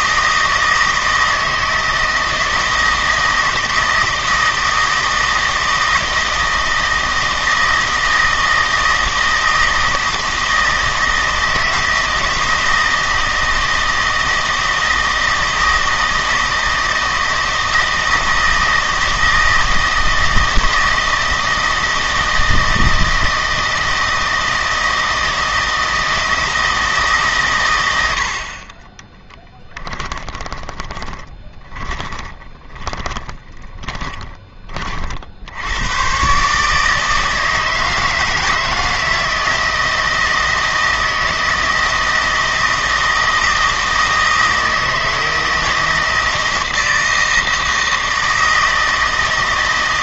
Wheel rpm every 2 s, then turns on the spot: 160, 160, 160, 160, 160, 160, 160, 160, 160, 160, 160, 160, 160, 160, 30, 20, 20, 40, 150, 160, 160, 160, 160, 160, 160.
30-34